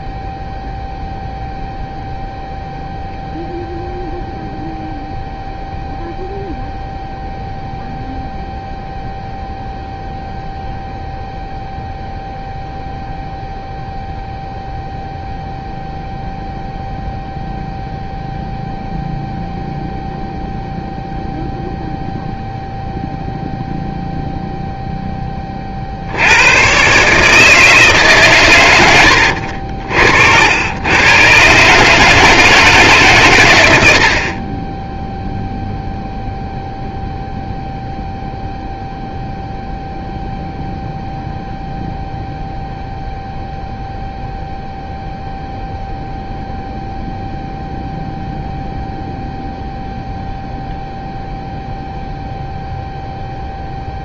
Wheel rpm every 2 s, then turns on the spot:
0, 0, 0, 0, 0, 0, 0, 0, 0, 0, 0, 0, 0, 110, 100, 90, 150, 20, 0, 0, 0, 0, 0, 0, 0, 0, 0.
34-36